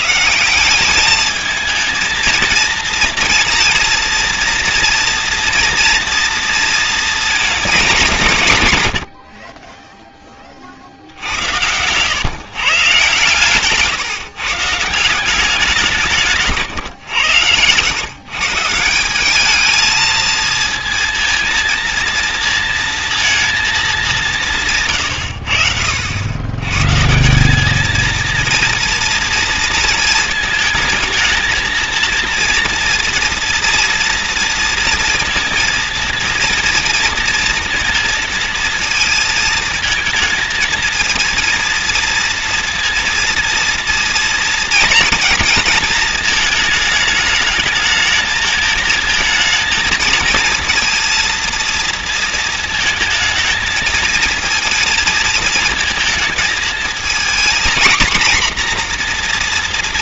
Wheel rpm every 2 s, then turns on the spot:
170, 230, 230, 240, 170, 50, 140, 170, 140, 170, 220, 230, 130, 140, 230, 220, 230, 230, 230, 230, 230, 230, 230, 220, 220, 230, 230, 230, 220, 240.
none